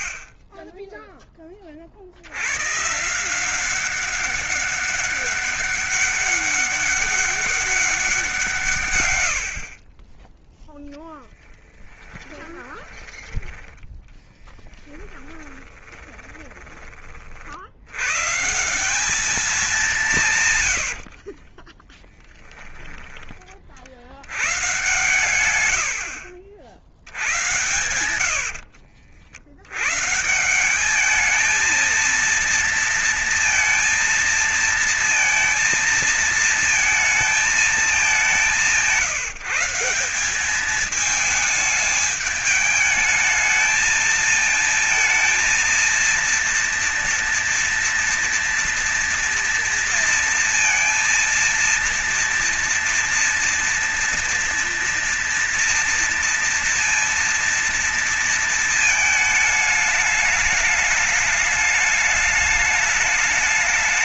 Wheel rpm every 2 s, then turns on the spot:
20, 130, 200, 200, 150, 10, 20, 10, 10, 170, 100, 10, 110, 80, 70, 180, 230, 230, 230, 170, 200, 210, 220, 230, 240, 230, 230, 240, 230, 230, 210, 210.
12-14 20-22 28-30